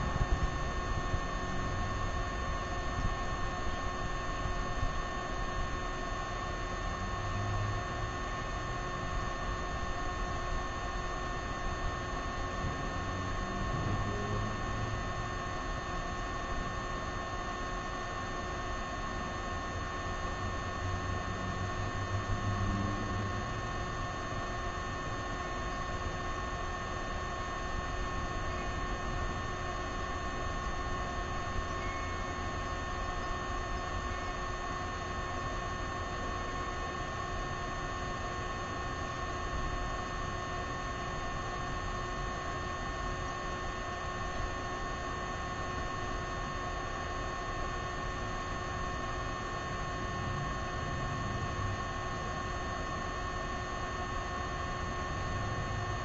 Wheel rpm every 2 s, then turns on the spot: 0, 0, 0, 0, 0, 0, 0, 0, 0, 0, 0, 0, 0, 0, 0, 0, 0, 0, 0, 0, 0, 0, 0, 0, 0, 0, 0, 0.
none